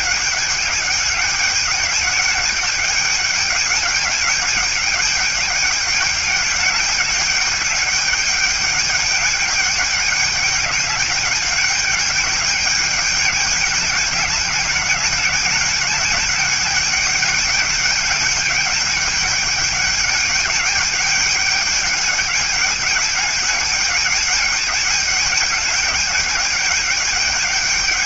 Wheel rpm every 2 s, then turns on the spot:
200, 210, 200, 200, 210, 210, 200, 200, 210, 210, 210, 210, 210, 210.
none